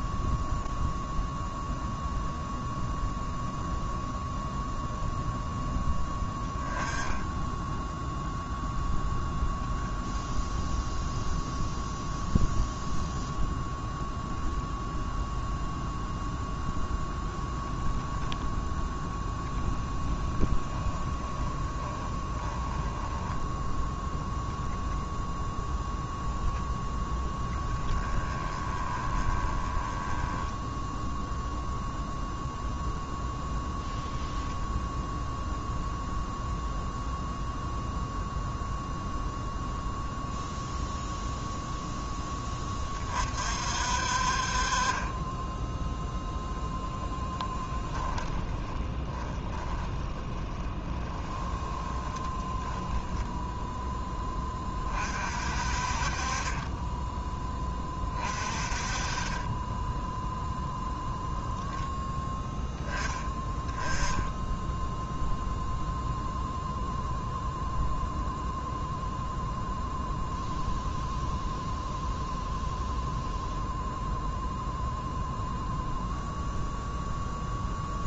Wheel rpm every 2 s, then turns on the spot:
0, 0, 0, 10, 0, 0, 0, 0, 10, 10, 10, 10, 0, 0, 20, 0, 0, 0, 0, 0, 0, 40, 20, 10, 10, 10, 0, 40, 10, 30, 0, 10, 0, 0, 0, 0, 0, 0, 0.
20-24 46-52